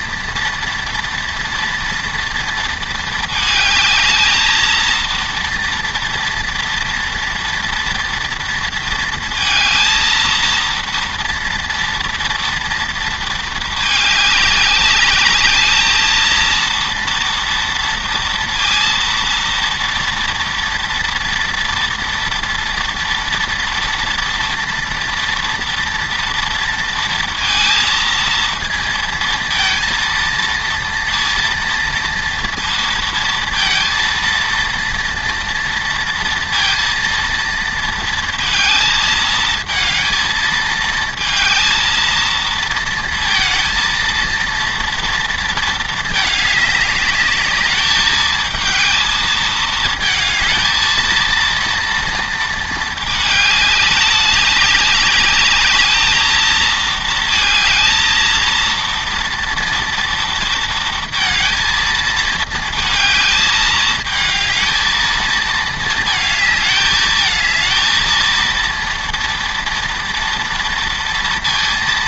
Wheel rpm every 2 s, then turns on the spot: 230, 230, 220, 230, 230, 230, 230, 200, 230, 230, 230, 230, 230, 230, 230, 230, 230, 230, 230, 230, 220, 230, 230, 210, 220, 220, 220, 200, 220, 230, 230, 220, 220, 220, 230, 230.
none